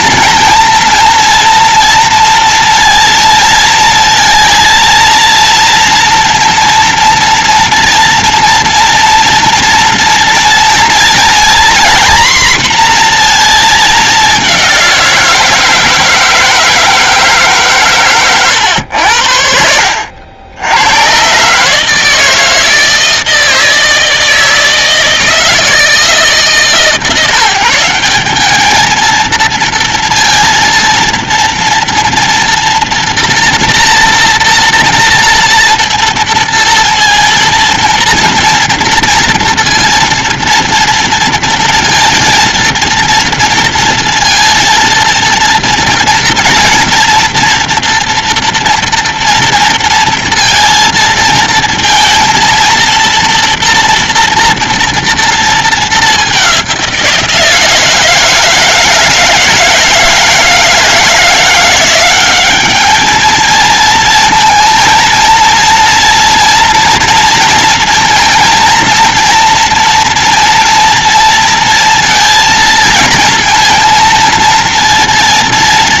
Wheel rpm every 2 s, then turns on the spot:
230, 230, 230, 230, 240, 230, 240, 180, 160, 90, 100, 160, 160, 150, 220, 230, 240, 240, 230, 230, 230, 230, 230, 230, 240, 230, 230, 230, 180, 160, 160, 210, 230, 230, 230, 230, 230, 230.
none